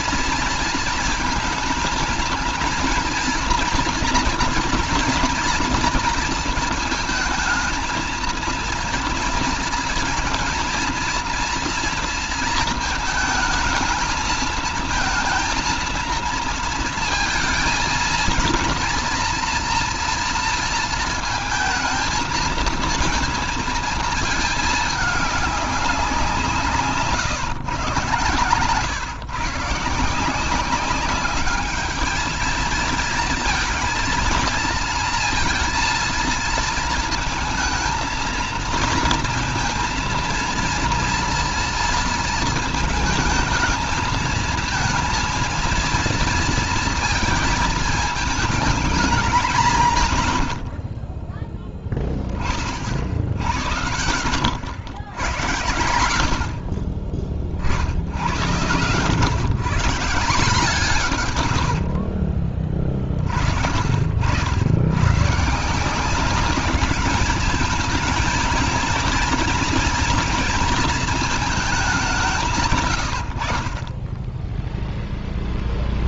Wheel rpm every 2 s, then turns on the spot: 230, 230, 230, 230, 230, 230, 220, 220, 230, 230, 230, 230, 210, 150, 130, 200, 220, 230, 220, 230, 230, 220, 230, 230, 210, 60, 50, 80, 40, 110, 160, 40, 110, 200, 230, 220, 110, 0.
none